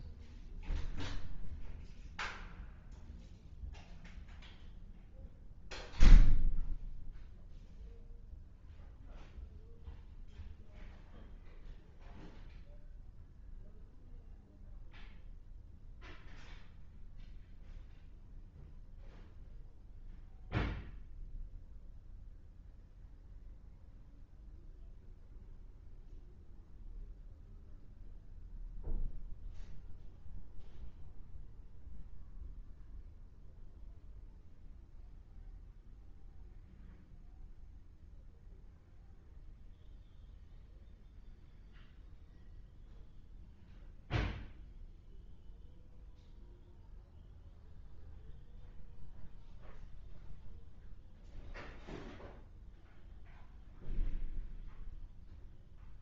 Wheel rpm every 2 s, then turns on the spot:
0, 0, 0, 0, 0, 0, 0, 0, 0, 0, 0, 0, 0, 0, 0, 0, 0, 0, 0, 0, 0, 0, 0, 0, 0, 0, 0, 0.
none